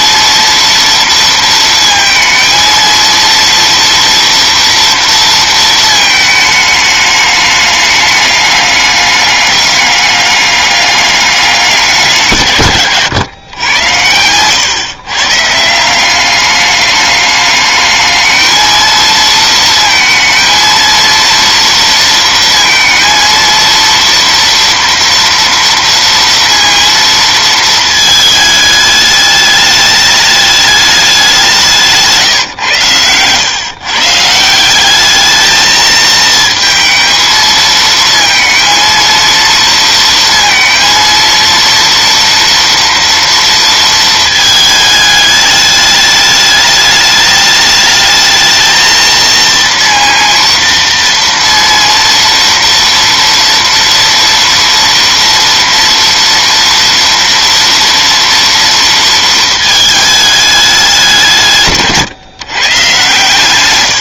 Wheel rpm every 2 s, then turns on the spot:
230, 230, 230, 210, 210, 200, 130, 120, 200, 220, 230, 230, 230, 230, 210, 210, 120, 180, 220, 230, 230, 230, 220, 210, 220, 230, 230, 230, 240, 230, 200, 140.
none